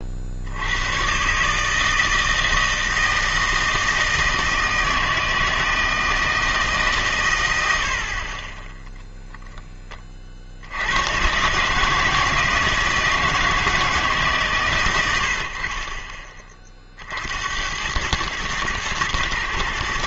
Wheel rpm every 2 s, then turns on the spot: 120, 160, 160, 130, 10, 110, 160, 100, 60, 110.
none